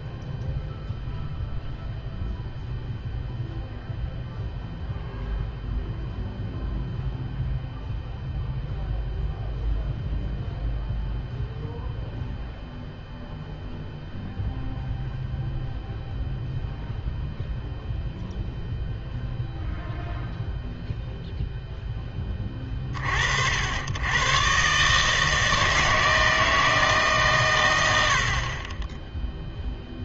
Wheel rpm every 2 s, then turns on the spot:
0, 0, 0, 0, 0, 0, 0, 0, 0, 0, 0, 20, 130, 160, 30.
none